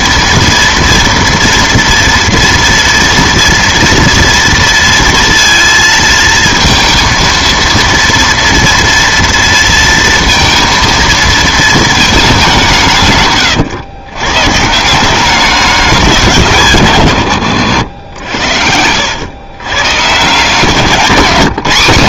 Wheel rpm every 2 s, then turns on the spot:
230, 230, 230, 230, 230, 230, 180, 150, 160, 80, 170.
none